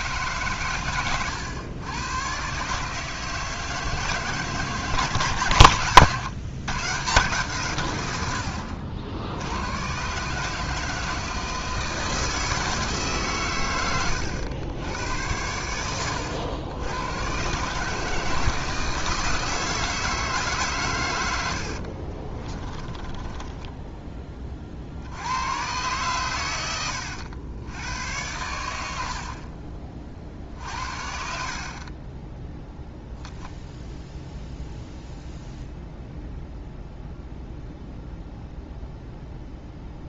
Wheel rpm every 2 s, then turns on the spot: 110, 150, 140, 150, 70, 160, 150, 100, 110, 160, 110, 20, 60, 90, 70, 60, 0, 0, 0, 0.
22-24